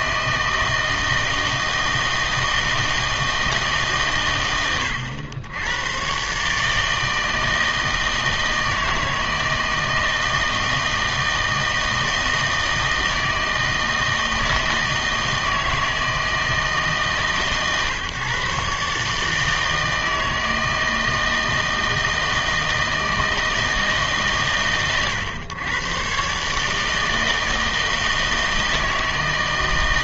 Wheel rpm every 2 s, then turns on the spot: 160, 160, 100, 160, 160, 160, 160, 160, 150, 140, 160, 160, 120, 160, 160.
none